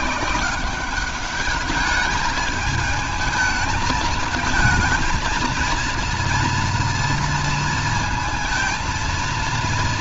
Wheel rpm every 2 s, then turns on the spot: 180, 220, 220, 230, 220.
none